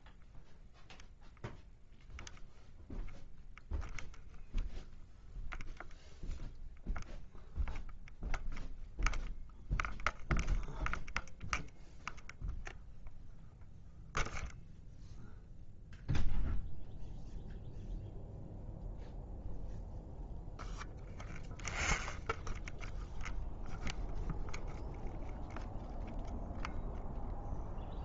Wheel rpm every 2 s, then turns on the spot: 0, 0, 0, 0, 0, 0, 0, 0, 0, 0, 0, 0, 0, 0.
none